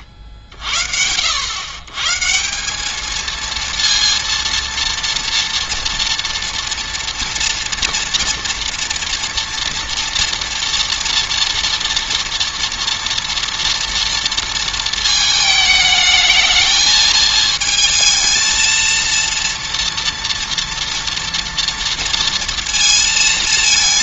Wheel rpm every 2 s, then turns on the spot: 40, 200, 230, 240, 230, 230, 230, 230, 220, 220, 240, 230.
none